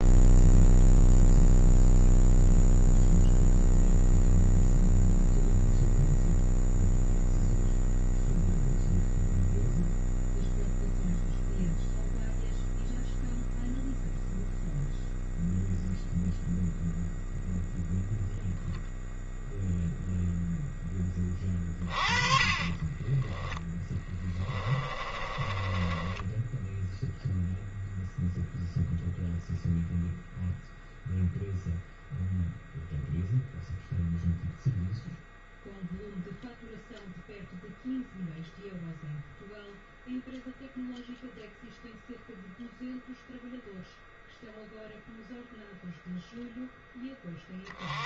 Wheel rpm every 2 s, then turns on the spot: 0, 0, 0, 0, 0, 0, 0, 0, 0, 0, 10, 30, 30, 0, 0, 0, 0, 0, 0, 0, 0, 0, 0, 10.
22-26